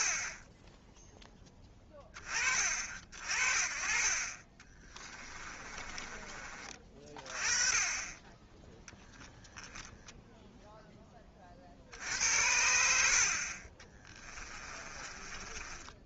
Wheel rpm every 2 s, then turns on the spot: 10, 40, 30, 30, 10, 0, 70, 20.
4-6 14-16